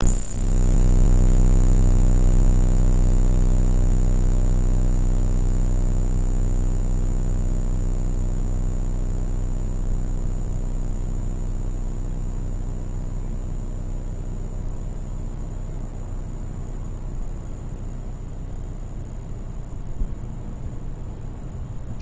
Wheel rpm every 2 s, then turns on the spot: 0, 0, 0, 0, 0, 0, 0, 0, 0, 0, 0.
none